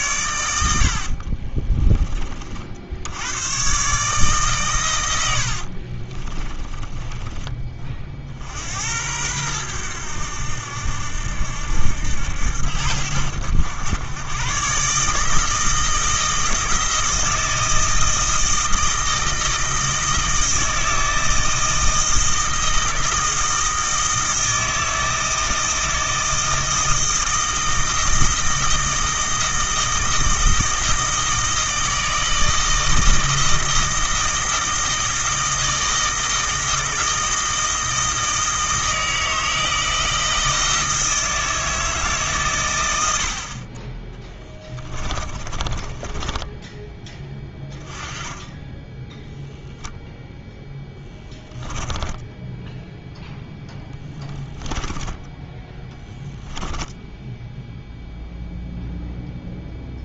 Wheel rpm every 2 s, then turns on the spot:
100, 60, 120, 20, 80, 80, 80, 120, 160, 160, 160, 160, 160, 160, 160, 160, 160, 160, 160, 160, 160, 130, 10, 10, 20, 10, 10, 20, 10, 0.
6-8 44-48 50-56